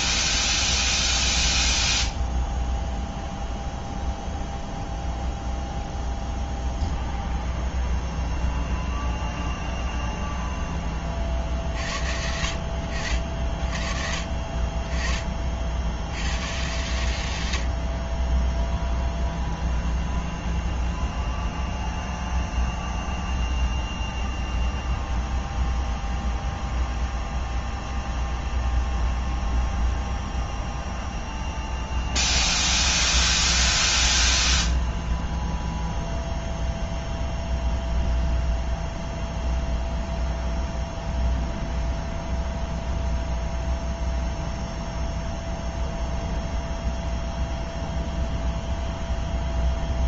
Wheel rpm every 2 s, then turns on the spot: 0, 0, 0, 0, 0, 0, 60, 40, 110, 20, 0, 0, 0, 0, 0, 0, 0, 0, 0, 0, 0, 0, 0, 0, 0.
none